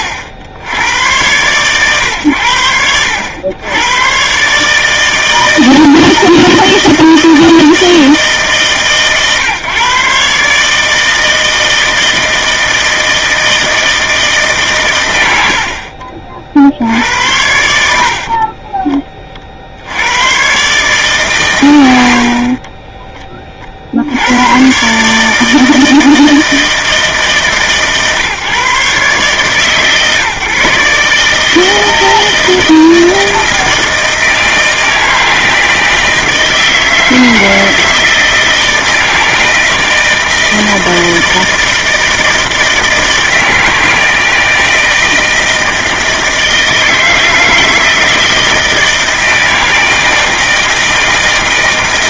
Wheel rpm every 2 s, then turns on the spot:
80, 80, 150, 160, 140, 150, 160, 120, 60, 40, 130, 30, 130, 160, 140, 150, 160, 160, 160, 160, 160, 160, 160, 160, 160, 160.
18-20